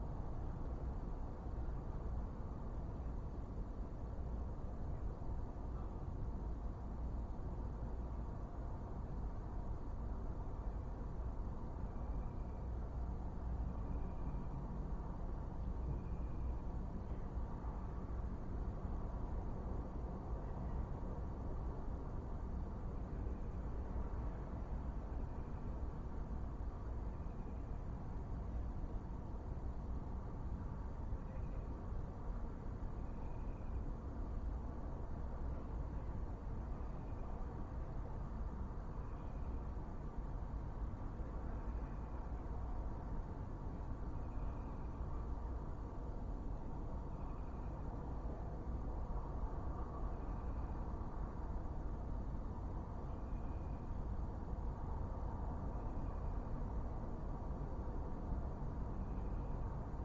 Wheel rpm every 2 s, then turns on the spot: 0, 0, 0, 0, 0, 0, 0, 0, 0, 0, 0, 0, 0, 0, 0, 0, 0, 0, 0, 0, 0, 0, 0, 0, 0, 0, 0, 0, 0, 0.
none